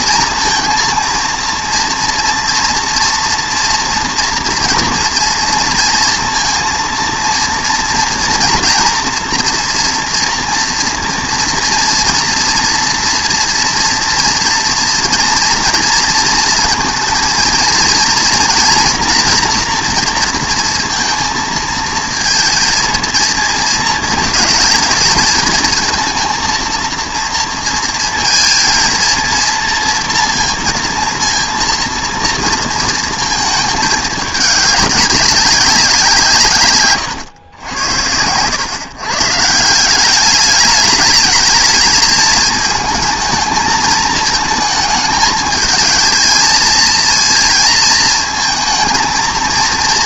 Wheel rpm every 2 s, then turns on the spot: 230, 230, 230, 230, 240, 230, 230, 230, 230, 230, 230, 230, 220, 230, 230, 230, 230, 200, 130, 130, 210, 220, 220, 220, 220.
none